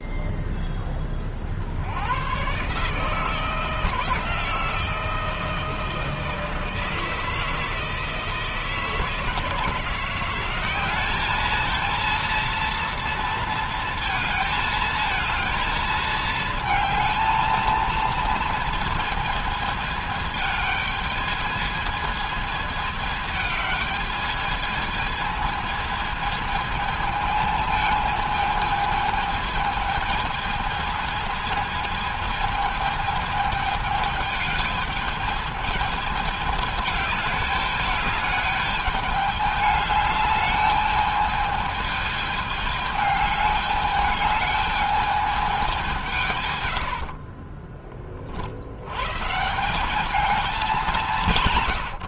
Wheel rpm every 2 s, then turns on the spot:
30, 150, 160, 160, 160, 210, 230, 220, 220, 220, 220, 210, 220, 220, 220, 220, 220, 210, 210, 210, 210, 210, 210, 60, 140, 170.
46-48